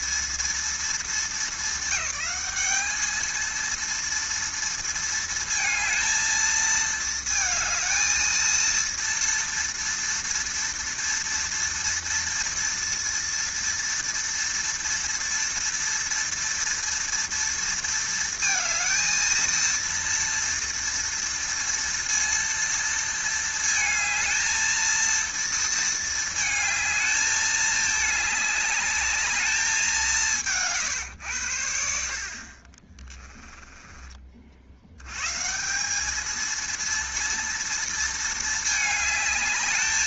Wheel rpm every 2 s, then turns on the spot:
220, 200, 230, 220, 230, 230, 230, 230, 230, 220, 230, 230, 230, 220, 200, 140, 30, 80, 230, 220.
none